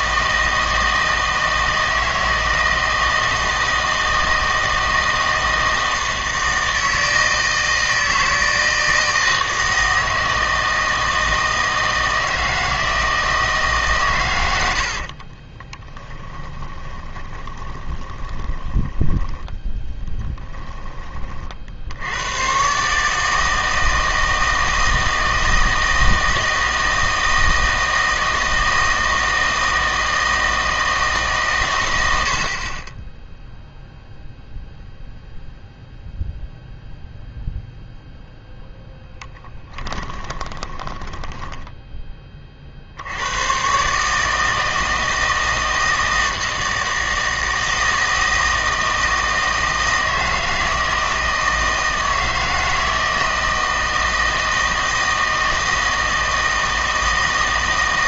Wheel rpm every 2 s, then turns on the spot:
160, 160, 160, 160, 160, 160, 160, 70, 20, 10, 20, 130, 160, 160, 160, 160, 40, 0, 0, 0, 20, 50, 160, 160, 160, 160, 160, 160, 160.
14-20 40-42